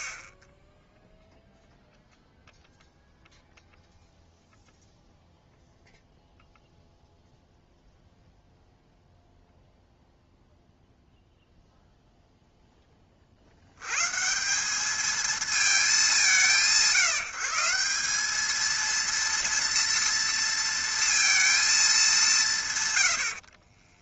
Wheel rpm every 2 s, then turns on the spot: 0, 0, 0, 0, 0, 0, 10, 210, 160, 230, 230, 140.
none